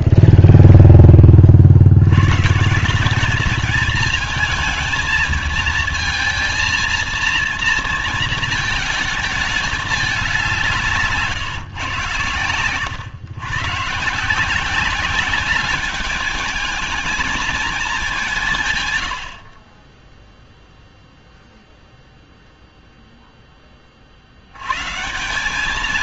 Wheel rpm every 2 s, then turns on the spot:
0, 160, 220, 230, 220, 180, 110, 180, 220, 160, 0, 0, 110.
none